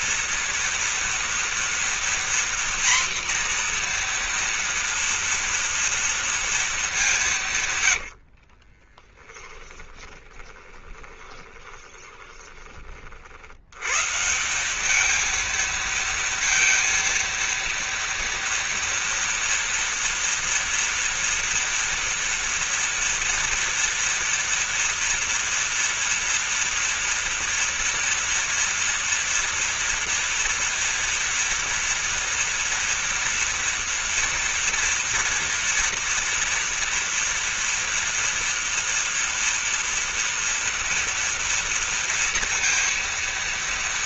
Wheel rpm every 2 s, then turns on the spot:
230, 240, 240, 220, 40, 20, 30, 190, 230, 230, 230, 230, 230, 230, 240, 230, 240, 230, 240, 240, 230, 230.
8-12